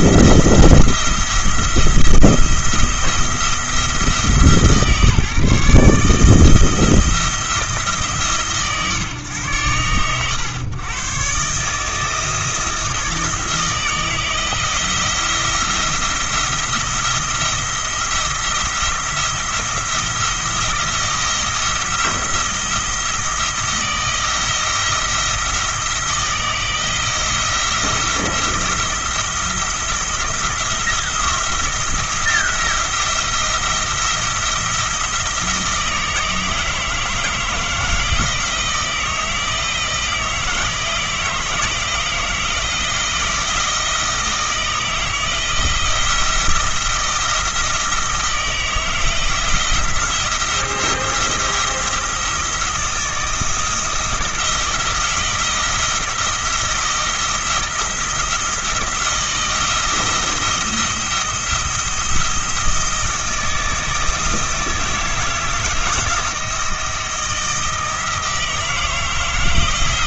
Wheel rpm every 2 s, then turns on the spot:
170, 170, 150, 170, 130, 120, 160, 170, 170, 170, 170, 170, 160, 170, 170, 170, 170, 170, 160, 160, 160, 170, 160, 160, 160, 170, 160, 170, 170, 170, 170, 170, 160, 170, 160.
none